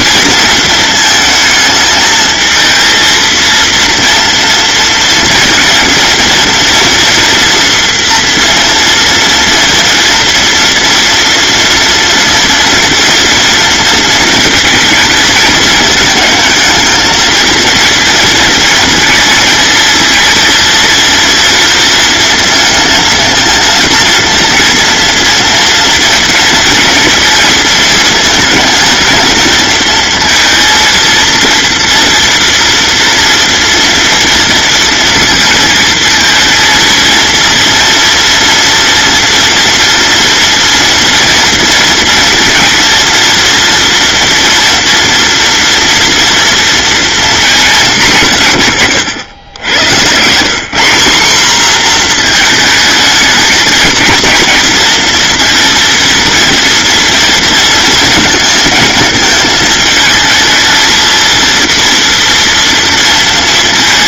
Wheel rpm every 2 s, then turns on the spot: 230, 220, 230, 230, 230, 230, 230, 230, 220, 230, 230, 230, 230, 230, 220, 230, 230, 240, 230, 230, 240, 240, 240, 230, 150, 160, 230, 230, 230, 220, 220, 230.
none